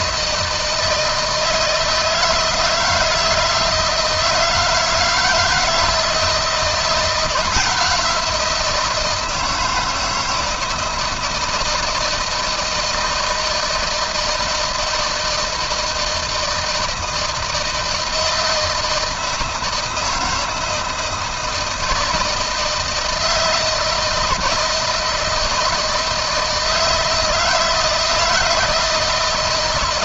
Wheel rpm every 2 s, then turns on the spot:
160, 170, 160, 170, 170, 160, 160, 160, 160, 160, 160, 160, 160, 160, 160.
none